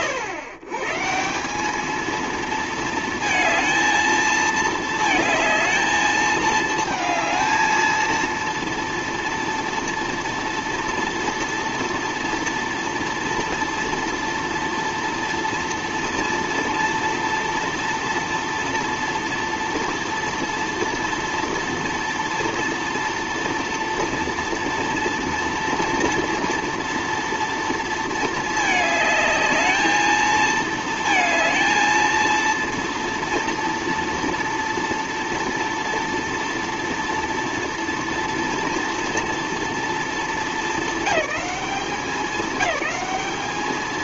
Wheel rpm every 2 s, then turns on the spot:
120, 220, 220, 220, 230, 230, 230, 230, 230, 230, 230, 230, 230, 230, 220, 220, 230, 230, 230, 230, 210, 190.
none